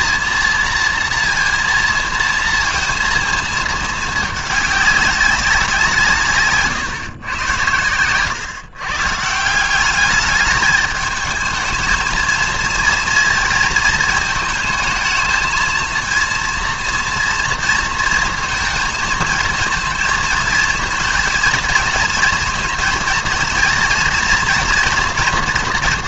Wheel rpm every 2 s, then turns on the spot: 230, 230, 210, 140, 130, 210, 230, 220, 230, 230, 220, 230, 240.
none